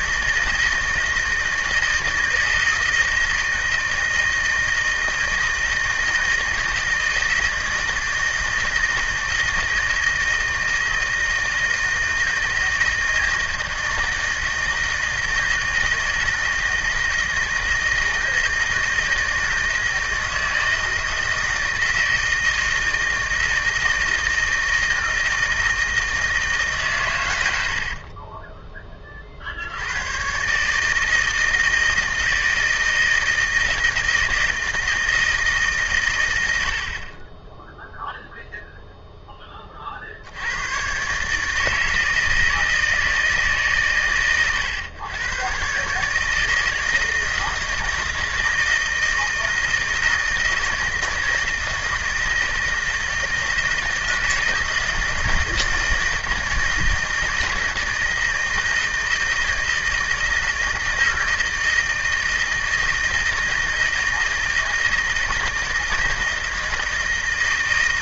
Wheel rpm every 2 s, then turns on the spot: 160, 160, 160, 160, 160, 160, 170, 160, 160, 160, 160, 160, 160, 140, 30, 150, 160, 160, 60, 0, 120, 160, 120, 160, 160, 160, 160, 160, 160, 160, 160, 160, 160, 160.
none